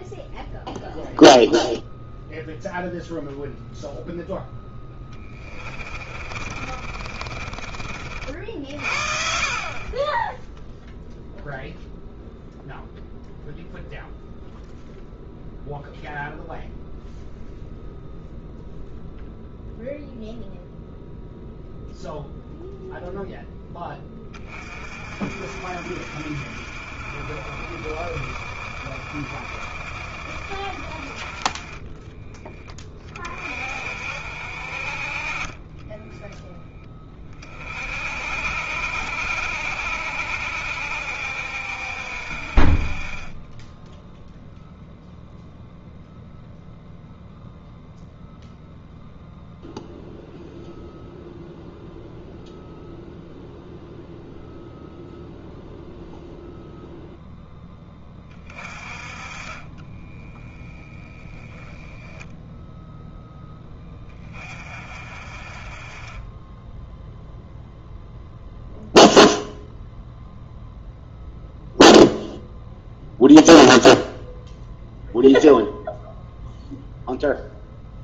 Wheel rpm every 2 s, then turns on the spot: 0, 0, 10, 40, 50, 0, 0, 0, 0, 0, 0, 0, 40, 50, 50, 40, 20, 50, 10, 60, 60, 30, 0, 0, 0, 0, 0, 0, 0, 30, 10, 0, 40, 0, 0, 0, 0, 0, 0.
4-8 58-60